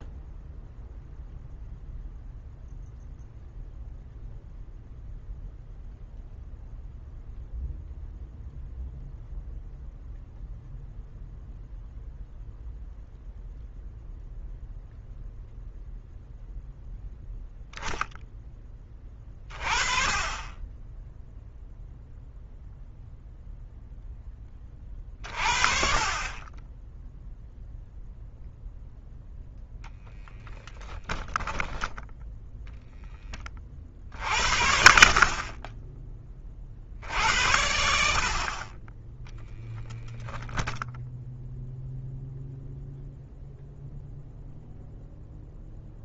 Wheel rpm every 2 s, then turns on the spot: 0, 0, 0, 0, 0, 0, 0, 0, 0, 10, 20, 0, 20, 20, 0, 20, 10, 50, 30, 40, 0, 0, 0.
30-32